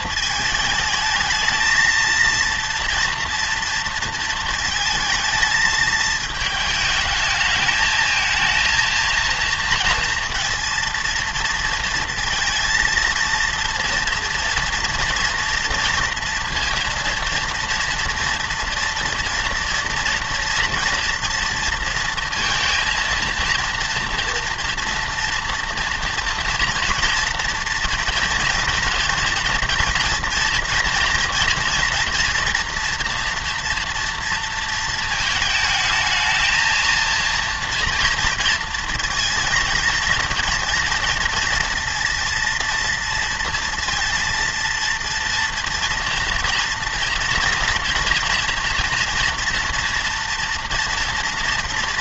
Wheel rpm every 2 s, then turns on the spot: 220, 230, 220, 220, 230, 230, 220, 240, 240, 230, 230, 230, 230, 230, 230, 240, 230, 230, 230, 230, 230, 230, 230, 230, 230, 240.
none